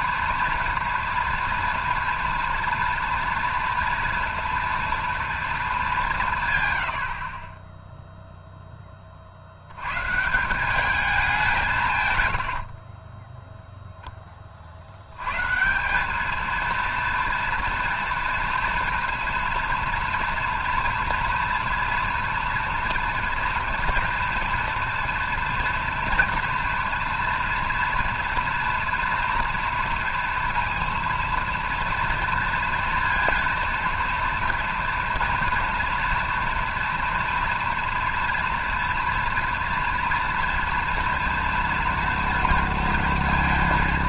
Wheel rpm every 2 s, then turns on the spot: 230, 230, 230, 70, 30, 200, 30, 90, 230, 230, 230, 230, 230, 230, 230, 230, 230, 230, 230, 240, 230, 230.
12-14